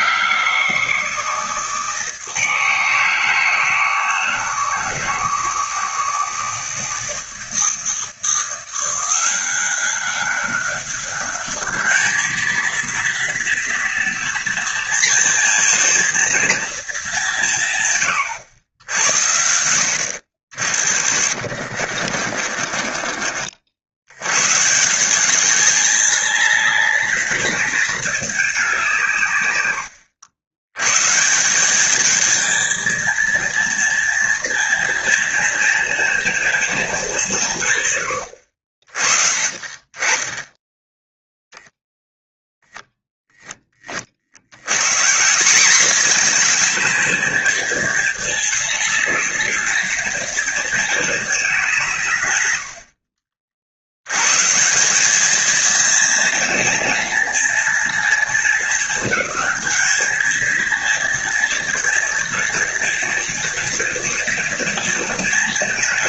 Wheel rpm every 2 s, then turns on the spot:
160, 160, 160, 160, 170, 200, 230, 230, 230, 90, 60, 30, 150, 220, 190, 110, 230, 230, 220, 60, 10, 0, 130, 230, 210, 220, 60, 190, 240, 220, 230, 220, 230.
20-24